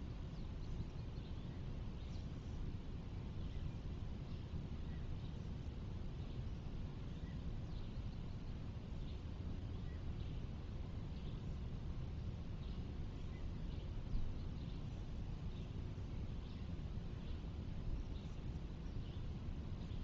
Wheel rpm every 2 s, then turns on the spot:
0, 0, 0, 0, 0, 0, 0, 0, 0, 0.
none